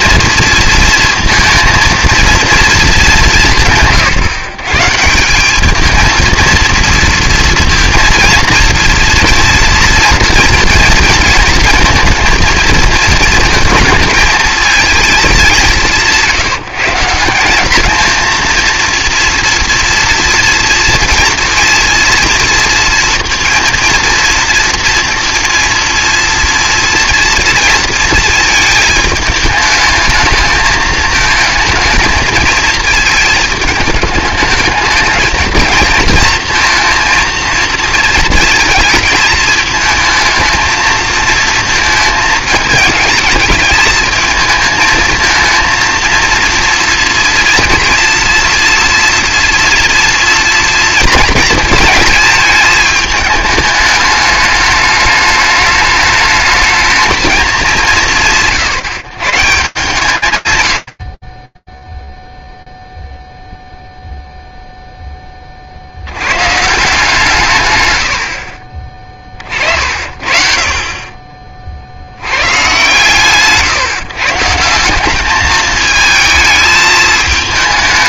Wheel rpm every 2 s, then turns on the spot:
230, 220, 150, 230, 230, 230, 230, 220, 150, 230, 230, 230, 230, 230, 220, 220, 220, 210, 230, 220, 220, 220, 220, 230, 230, 230, 220, 210, 220, 130, 90, 0, 0, 150, 40, 40, 140, 180, 220.
none